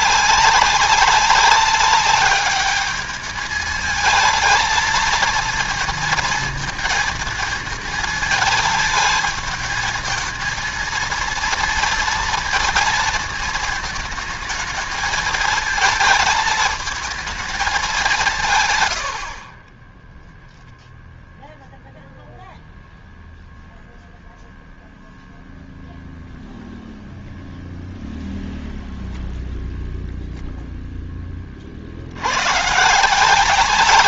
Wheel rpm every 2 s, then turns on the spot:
190, 210, 220, 220, 220, 230, 230, 220, 220, 120, 0, 0, 0, 0, 0, 0, 130.
none